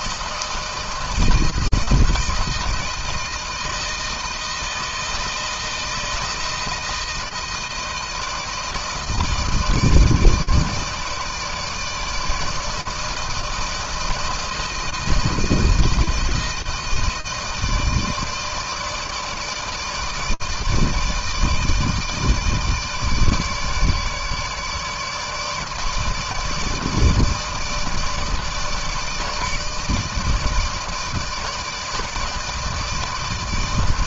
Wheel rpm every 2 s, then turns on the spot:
160, 160, 160, 160, 160, 160, 160, 170, 160, 160, 160, 160, 150, 160, 160, 160, 160.
none